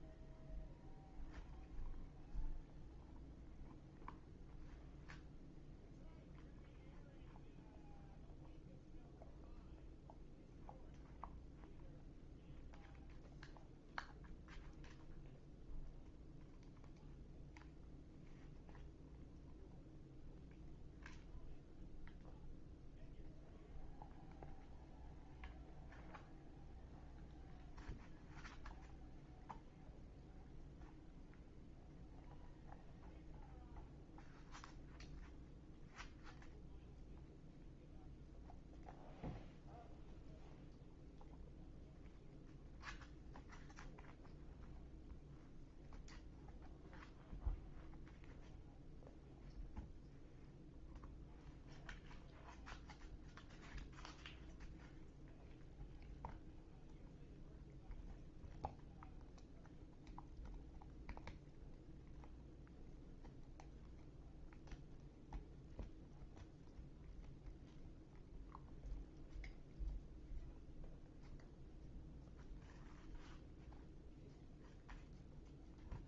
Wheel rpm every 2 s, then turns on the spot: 0, 0, 0, 0, 0, 0, 0, 0, 0, 0, 0, 0, 0, 0, 0, 0, 0, 0, 0, 0, 0, 0, 0, 0, 0, 0, 0, 0, 0, 0, 0, 0, 0, 0, 0, 0, 0, 0.
none